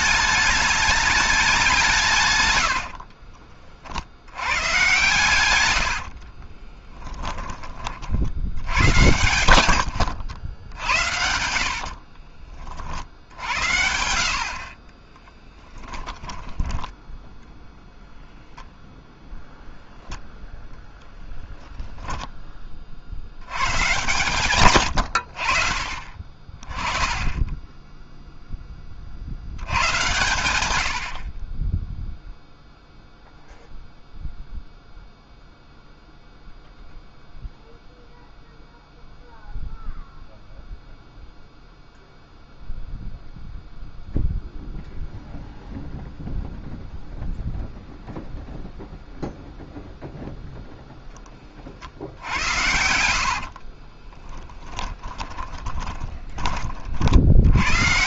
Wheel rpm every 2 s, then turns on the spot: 210, 60, 120, 30, 100, 90, 60, 30, 10, 0, 0, 50, 90, 20, 40, 60, 0, 0, 0, 0, 0, 0, 0, 0, 0, 10, 80, 10, 50.
2-12 14-18 52-56